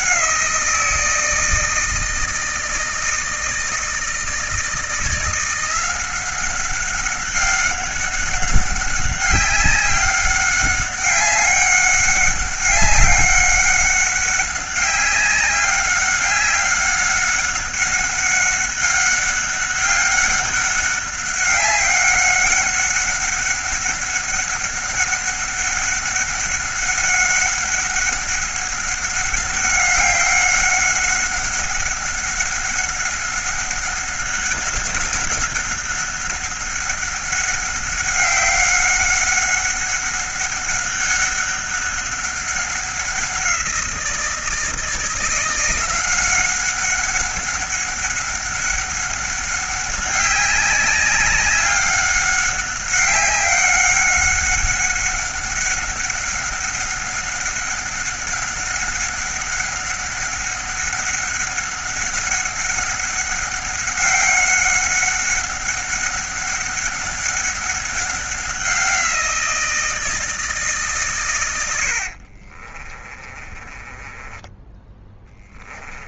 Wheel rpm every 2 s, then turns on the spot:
160, 160, 170, 190, 190, 200, 190, 190, 200, 200, 200, 200, 200, 200, 200, 200, 190, 190, 190, 190, 200, 190, 170, 190, 200, 200, 200, 200, 200, 190, 200, 200, 200, 200, 180, 130, 20, 10.
72-76